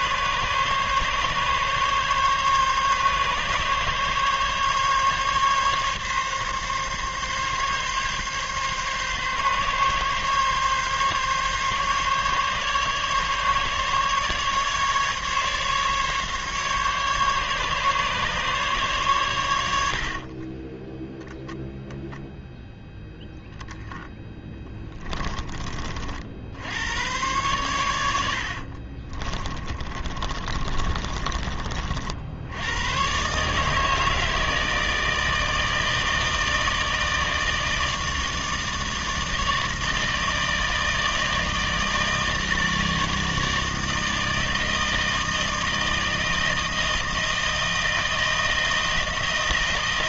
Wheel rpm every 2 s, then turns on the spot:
140, 140, 140, 140, 140, 140, 140, 140, 150, 140, 10, 0, 10, 80, 60, 30, 100, 160, 160, 160, 160, 160, 160, 160, 160.
20-22 24-26 28-32